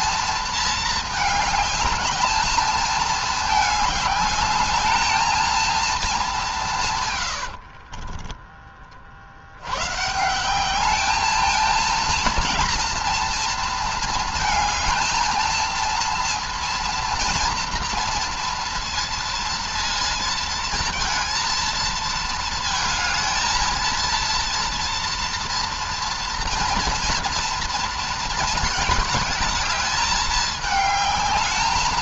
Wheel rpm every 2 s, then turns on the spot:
220, 220, 210, 180, 20, 190, 230, 220, 230, 230, 230, 220, 230, 230, 220, 220.
none